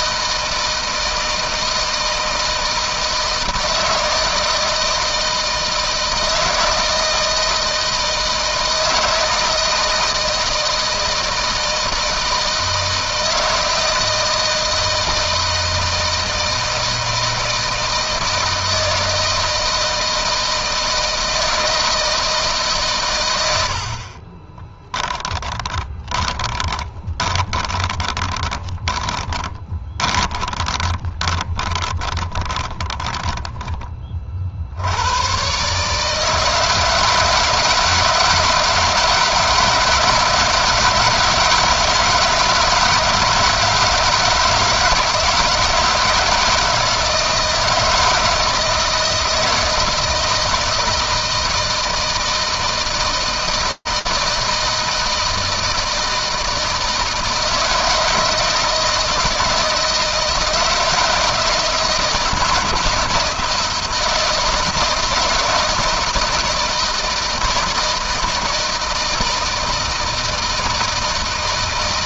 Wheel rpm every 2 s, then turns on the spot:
160, 160, 160, 160, 160, 160, 160, 160, 160, 160, 160, 140, 20, 20, 20, 20, 20, 70, 160, 160, 160, 160, 160, 160, 160, 160, 160, 160, 160, 160, 160, 170, 160, 160, 160, 160.
24-34